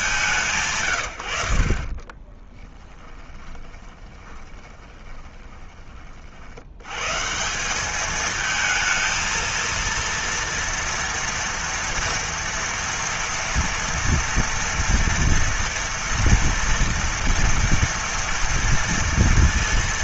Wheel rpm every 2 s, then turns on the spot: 190, 20, 20, 40, 210, 230, 230, 230, 230, 230.
2-6